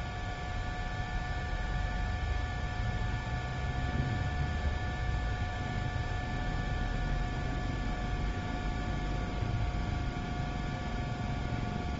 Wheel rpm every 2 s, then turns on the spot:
0, 0, 0, 0, 0, 0.
none